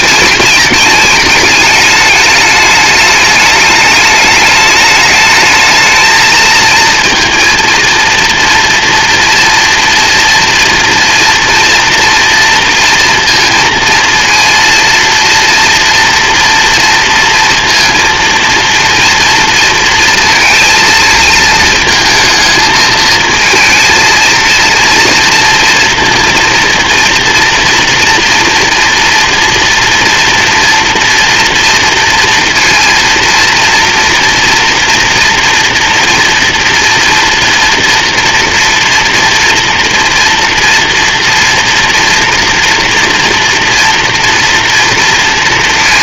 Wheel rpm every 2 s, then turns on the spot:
210, 210, 210, 230, 230, 230, 230, 230, 230, 230, 220, 220, 230, 230, 240, 230, 230, 230, 230, 230, 230, 230, 230.
none